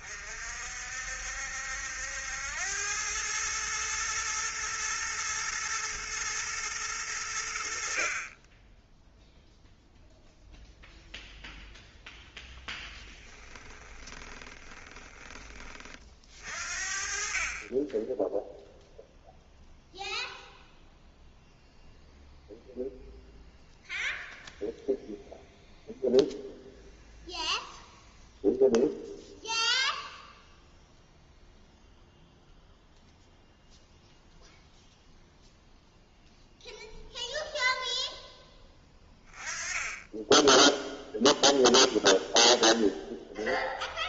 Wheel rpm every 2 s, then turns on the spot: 50, 100, 110, 110, 10, 0, 10, 20, 50, 0, 0, 0, 0, 0, 0, 0, 0, 0, 0, 20, 0, 0.
12-16